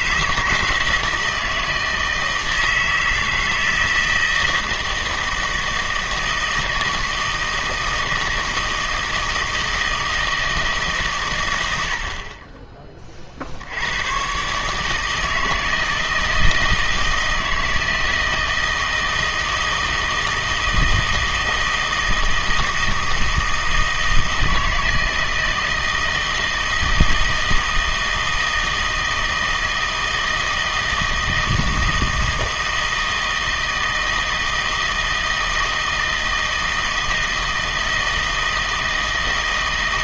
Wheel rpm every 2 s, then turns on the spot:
160, 160, 160, 160, 160, 160, 30, 140, 160, 160, 160, 160, 160, 160, 160, 160, 160, 160, 160, 160.
none